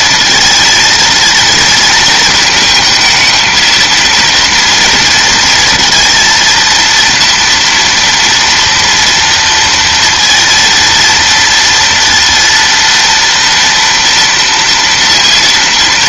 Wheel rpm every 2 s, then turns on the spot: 230, 220, 230, 230, 240, 230, 230, 230.
none